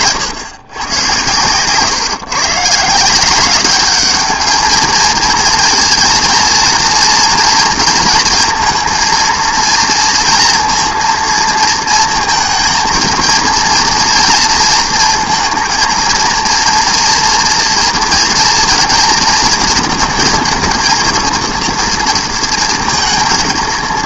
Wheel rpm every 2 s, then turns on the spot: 120, 160, 220, 230, 230, 230, 230, 230, 230, 230, 230, 230.
none